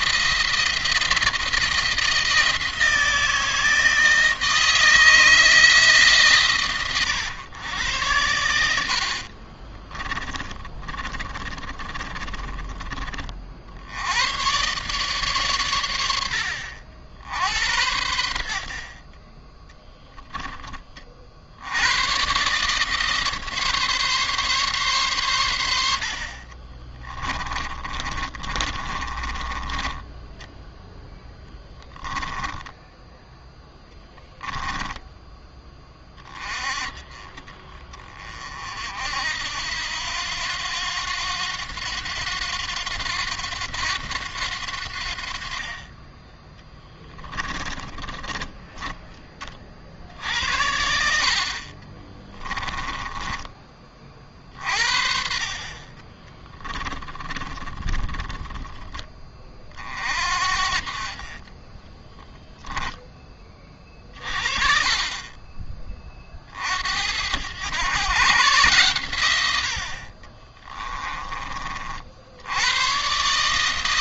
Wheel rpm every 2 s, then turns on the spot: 170, 160, 160, 130, 80, 30, 30, 130, 70, 50, 30, 140, 140, 40, 40, 20, 20, 20, 30, 50, 90, 90, 80, 10, 10, 70, 20, 40, 20, 20, 40, 10, 30, 60, 130, 30, 100.
10-12 26-36 46-50 52-54 56-58 70-72